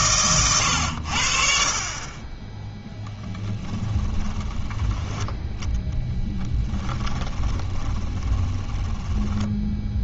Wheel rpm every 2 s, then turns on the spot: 100, 10, 10, 10, 20.
4-6 8-10